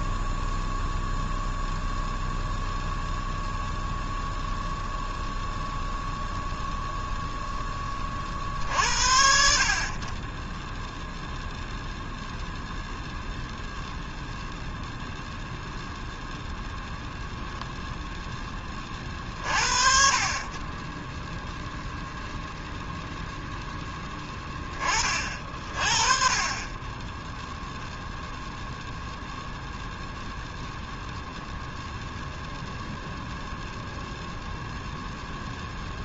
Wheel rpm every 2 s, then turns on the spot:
0, 0, 0, 0, 60, 10, 0, 0, 0, 20, 20, 0, 20, 30, 0, 0, 0, 0.
none